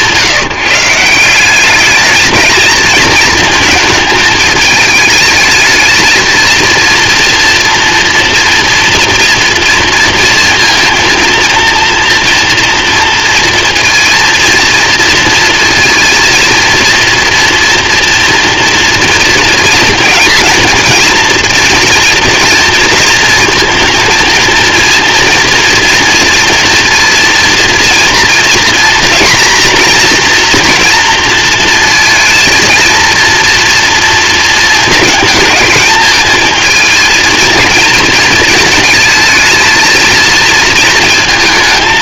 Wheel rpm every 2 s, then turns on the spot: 160, 230, 220, 230, 230, 230, 240, 230, 230, 230, 230, 230, 230, 230, 230, 240, 230, 220, 220, 230, 220.
none